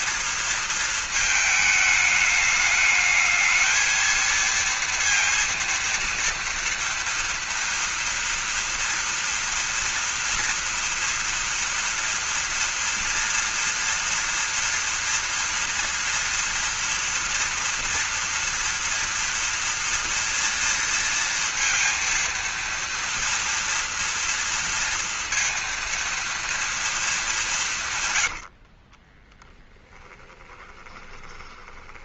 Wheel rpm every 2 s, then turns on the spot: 220, 210, 230, 240, 230, 230, 230, 230, 230, 230, 230, 230, 230, 220, 40, 20.
28-32